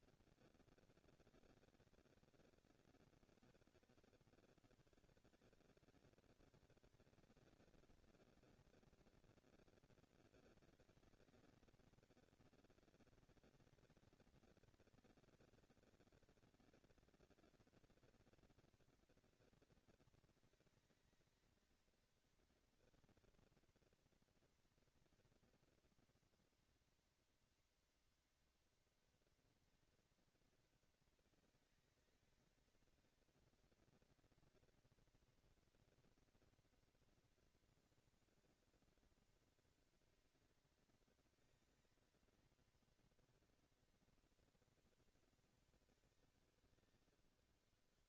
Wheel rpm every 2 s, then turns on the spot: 210, 150, 140, 210, 230, 220, 220, 220, 230, 230, 230, 230, 230, 230, 230, 230, 220, 230, 230, 230, 230, 230, 230, 200.
none